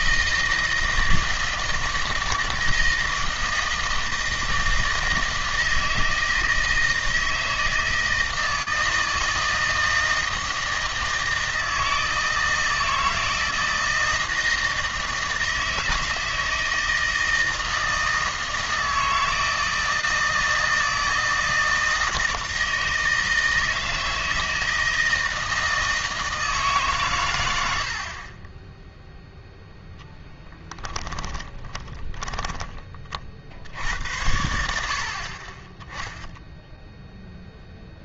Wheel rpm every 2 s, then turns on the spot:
160, 160, 160, 160, 160, 160, 160, 160, 160, 160, 160, 160, 160, 150, 10, 10, 30, 70, 0.
30-32